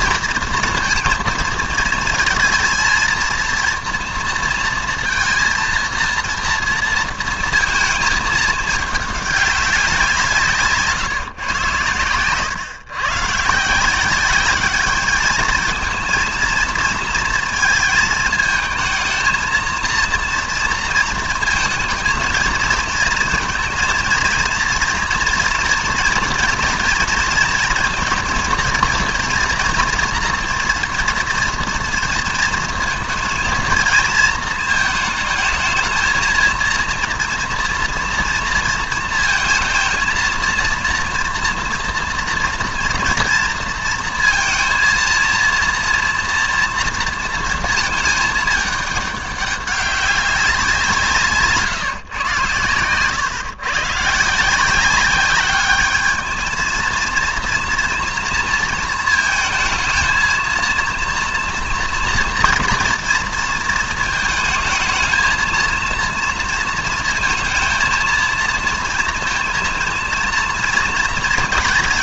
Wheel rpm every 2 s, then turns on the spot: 230, 220, 230, 230, 210, 150, 120, 200, 230, 220, 230, 220, 230, 230, 230, 230, 230, 220, 230, 230, 230, 230, 230, 230, 210, 180, 120, 180, 230, 230, 230, 240, 220, 230, 230, 230.
none